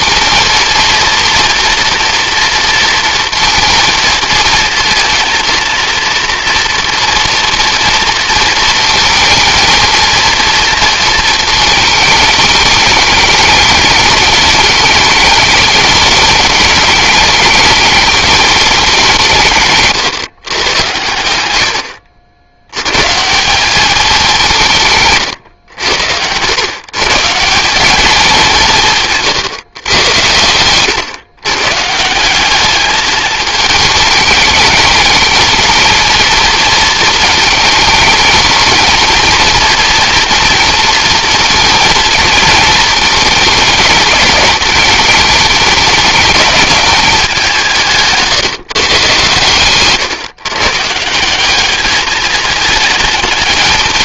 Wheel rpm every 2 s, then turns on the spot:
230, 230, 230, 230, 230, 230, 210, 210, 200, 170, 100, 140, 140, 150, 160, 120, 210, 220, 220, 220, 230, 220, 210, 210, 130, 160, 220.
none